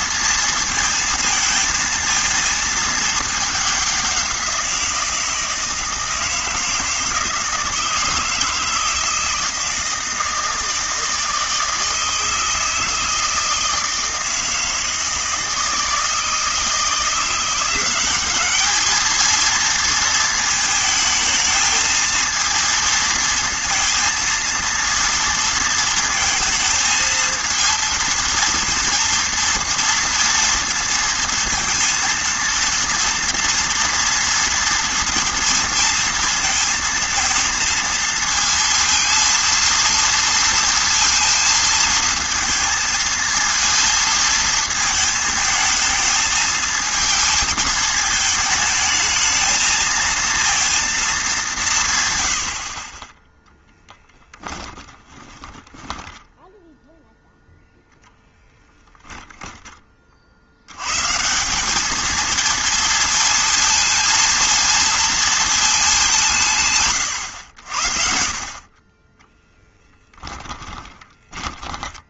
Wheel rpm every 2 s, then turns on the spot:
230, 220, 180, 160, 160, 160, 160, 160, 160, 210, 220, 230, 230, 230, 230, 230, 230, 230, 220, 230, 230, 230, 230, 220, 220, 230, 60, 10, 0, 10, 80, 230, 230, 150, 40, 20.
54-56 70-72